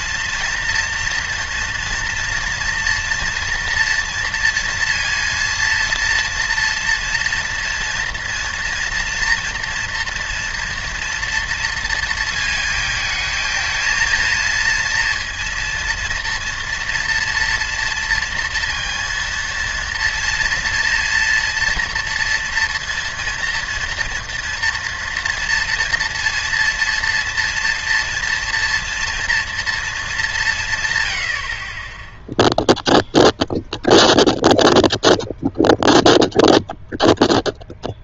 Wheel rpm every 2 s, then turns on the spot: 230, 230, 230, 230, 230, 230, 220, 230, 230, 230, 240, 230, 230, 230, 230, 160, 0, 0, 0.
none